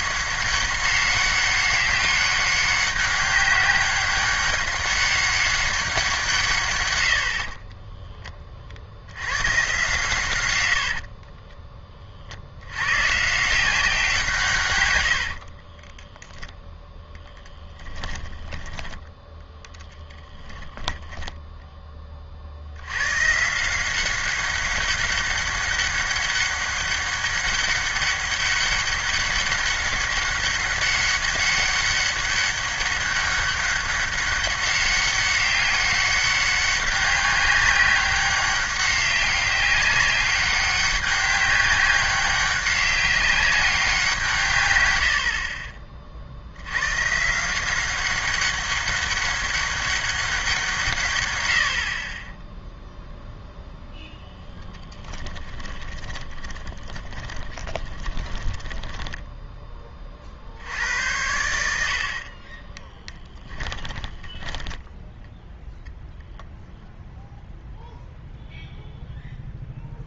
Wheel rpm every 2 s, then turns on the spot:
200, 200, 200, 130, 40, 100, 80, 140, 0, 10, 10, 70, 200, 200, 200, 200, 200, 200, 200, 190, 200, 190, 130, 80, 200, 170, 0, 0, 20, 20, 70, 30, 10, 0, 0.
10-12 20-22 56-60 62-66